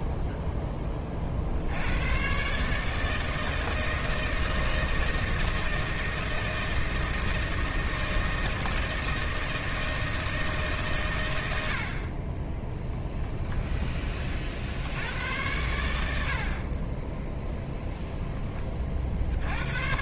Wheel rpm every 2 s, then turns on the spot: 20, 160, 170, 160, 160, 130, 10, 80, 20, 40.
12-14 16-18